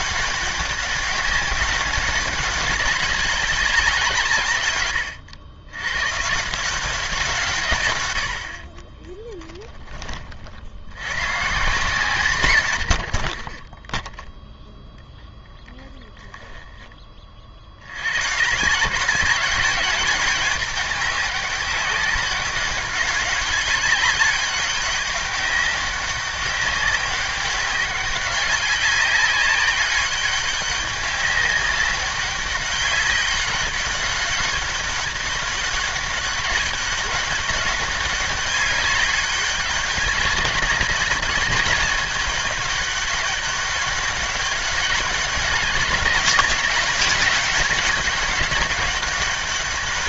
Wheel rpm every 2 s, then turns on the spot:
200, 190, 120, 160, 50, 60, 110, 10, 10, 150, 210, 200, 200, 200, 190, 200, 190, 200, 200, 200, 190, 200, 200, 200, 200.
none